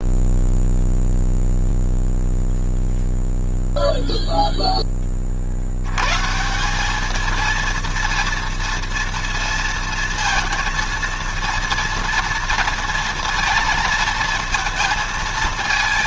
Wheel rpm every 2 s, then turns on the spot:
0, 0, 10, 190, 230, 230, 230, 220.
none